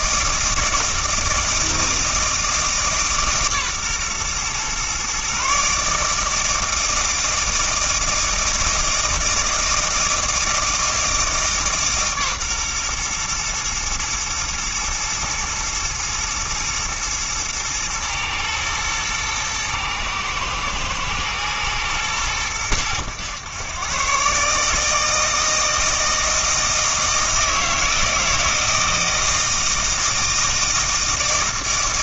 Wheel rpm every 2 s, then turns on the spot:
160, 150, 130, 160, 160, 160, 130, 120, 120, 110, 110, 100, 150, 160, 160, 160.
none